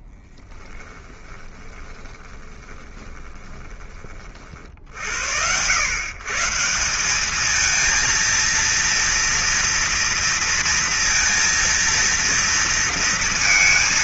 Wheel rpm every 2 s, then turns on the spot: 10, 20, 80, 190, 230, 230, 230.
0-4